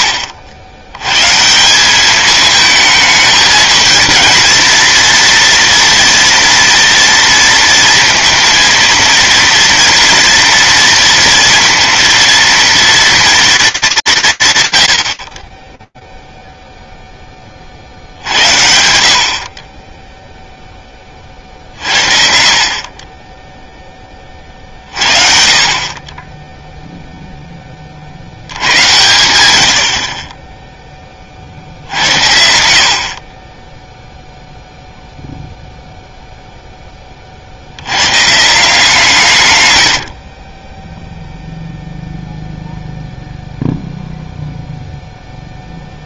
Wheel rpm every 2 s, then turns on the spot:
60, 210, 230, 240, 230, 230, 230, 180, 0, 60, 10, 40, 50, 0, 100, 50, 30, 0, 20, 160, 10, 0, 0.
none